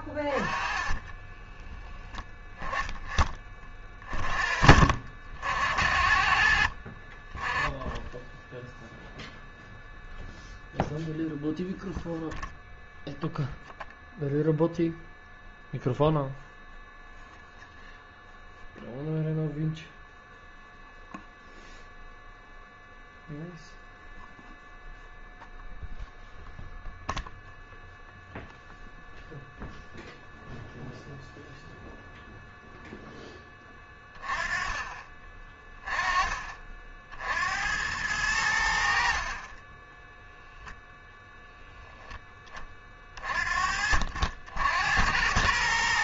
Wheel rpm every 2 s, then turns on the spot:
20, 10, 50, 50, 0, 0, 0, 0, 0, 0, 0, 0, 0, 0, 0, 0, 0, 20, 50, 70, 0, 20, 80.
0-2